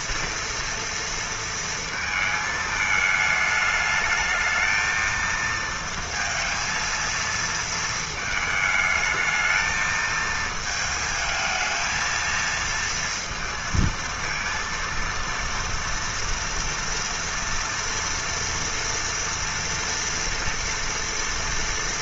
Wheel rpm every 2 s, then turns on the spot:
230, 220, 220, 230, 220, 220, 230, 230, 230, 240, 230.
none